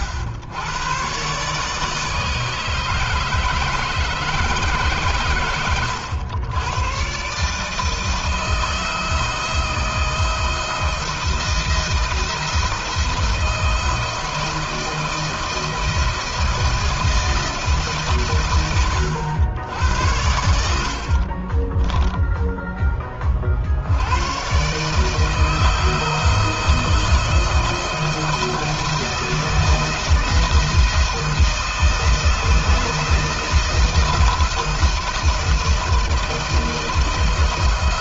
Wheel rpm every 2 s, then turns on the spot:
120, 150, 140, 120, 160, 170, 160, 160, 160, 110, 70, 20, 150, 170, 170, 160, 160, 160, 160.
20-22